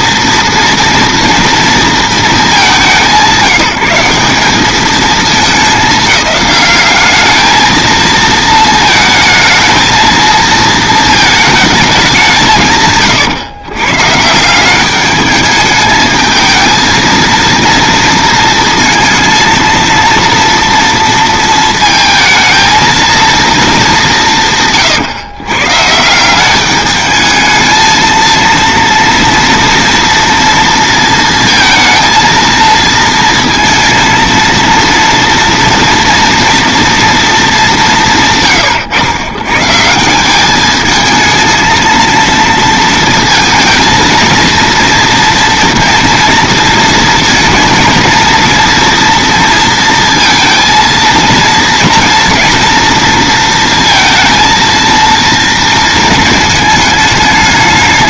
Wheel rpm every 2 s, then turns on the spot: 230, 200, 210, 200, 220, 220, 140, 190, 220, 230, 230, 230, 140, 210, 230, 230, 230, 230, 240, 120, 210, 230, 230, 230, 230, 230, 230, 230, 220.
none